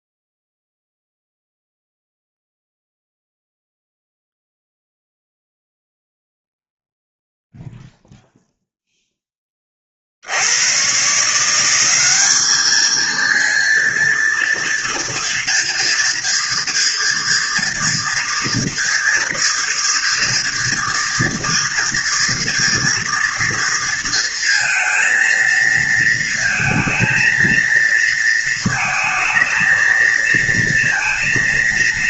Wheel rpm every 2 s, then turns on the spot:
0, 0, 0, 0, 0, 100, 220, 230, 230, 230, 230, 230, 230, 230, 230, 230.
none